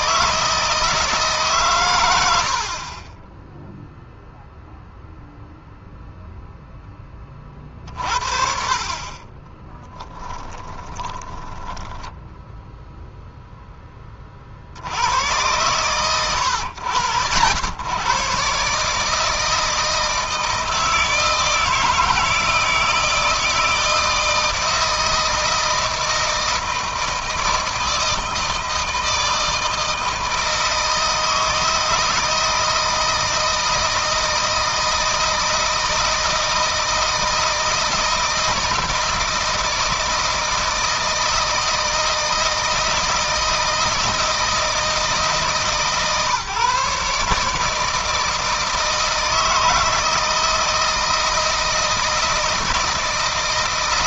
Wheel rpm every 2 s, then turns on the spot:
160, 40, 0, 10, 40, 20, 0, 70, 90, 150, 160, 160, 160, 160, 160, 160, 160, 160, 160, 160, 160, 160, 160, 150, 160, 160, 160.
10-12